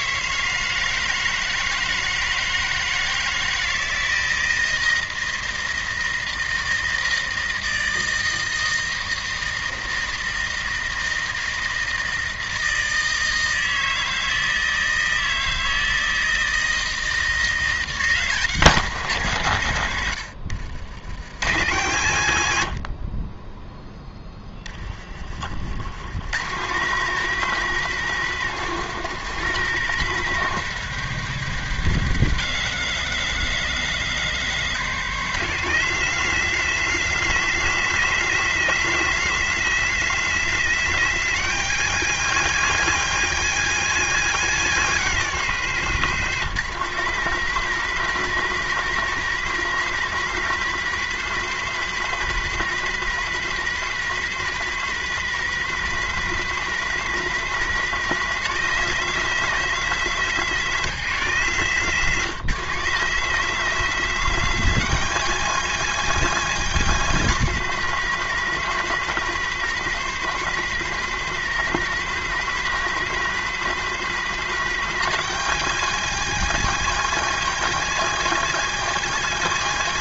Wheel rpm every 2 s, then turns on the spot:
160, 160, 160, 160, 160, 160, 160, 160, 160, 170, 90, 60, 30, 170, 190, 190, 180, 180, 200, 200, 200, 200, 200, 190, 200, 200, 200, 200, 200, 200, 190, 180, 200, 200, 200, 200, 200, 200, 200, 200.
22-26